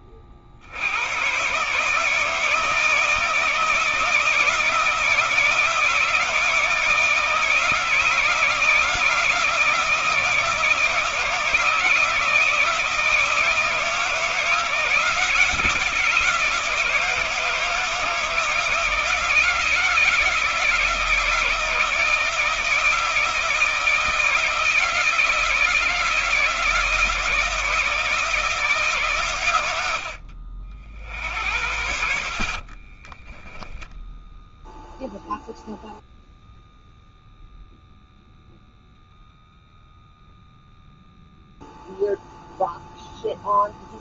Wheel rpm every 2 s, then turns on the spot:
70, 160, 170, 160, 160, 160, 160, 160, 160, 160, 160, 160, 160, 160, 160, 60, 30, 0, 0, 0, 0, 0.
32-34